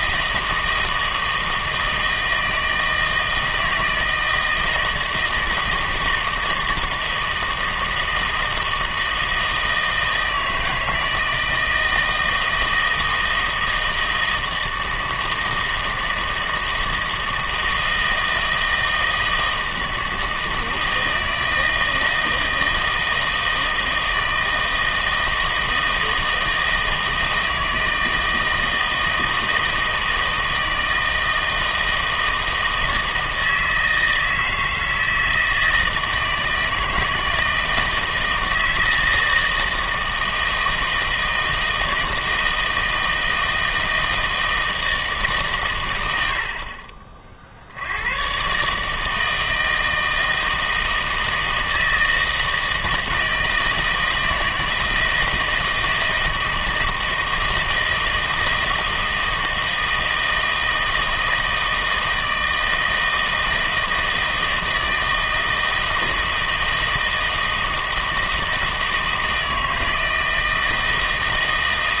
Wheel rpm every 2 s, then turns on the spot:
160, 160, 160, 160, 160, 160, 160, 160, 160, 160, 160, 160, 160, 160, 160, 160, 160, 160, 160, 160, 160, 160, 160, 40, 130, 160, 160, 160, 160, 160, 160, 160, 160, 160, 160, 160.
none